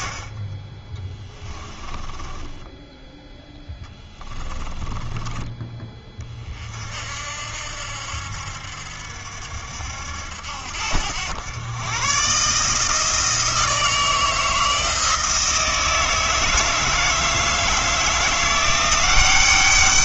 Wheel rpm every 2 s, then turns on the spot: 10, 10, 20, 50, 60, 80, 160, 160, 160, 180.
4-6